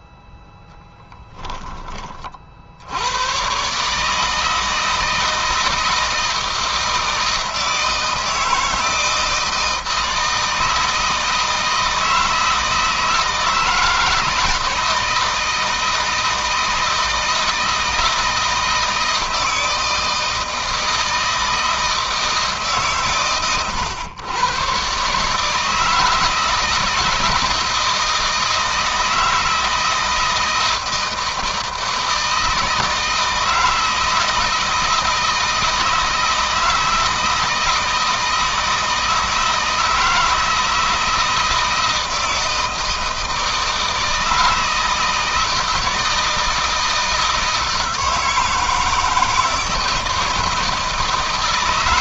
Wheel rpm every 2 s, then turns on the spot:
10, 80, 160, 160, 160, 160, 160, 160, 160, 160, 160, 140, 130, 160, 160, 160, 160, 160, 160, 160, 160, 160, 160, 160, 160, 160.
none